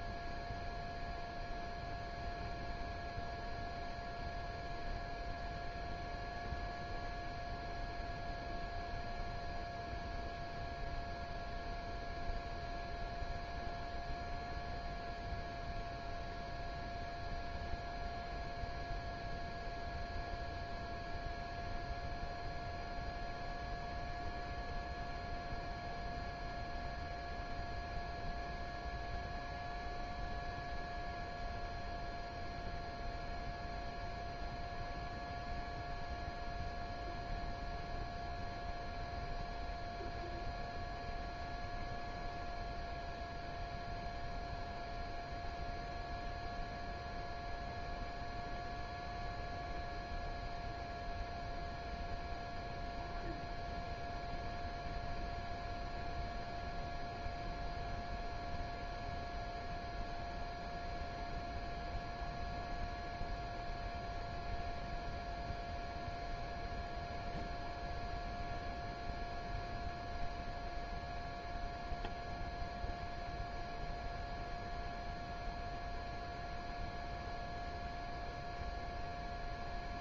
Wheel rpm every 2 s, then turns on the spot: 0, 0, 0, 0, 0, 0, 0, 0, 0, 0, 0, 0, 0, 0, 0, 0, 0, 0, 0, 0, 0, 0, 0, 0, 0, 0, 0, 0, 0, 0, 0, 0, 0, 0, 0, 0, 0, 0, 0, 0.
none